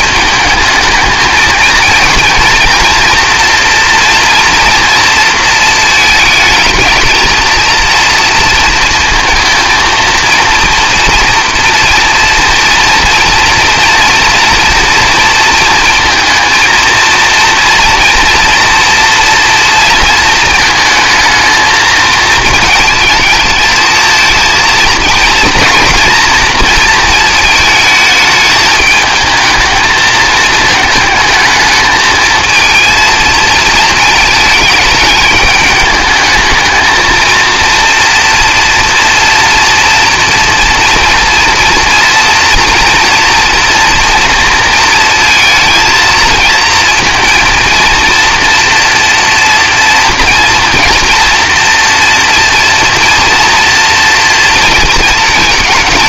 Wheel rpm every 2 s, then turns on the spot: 220, 230, 230, 220, 230, 230, 230, 230, 230, 240, 220, 220, 230, 230, 220, 220, 230, 220, 220, 230, 230, 230, 230, 220, 230, 230, 240, 230.
none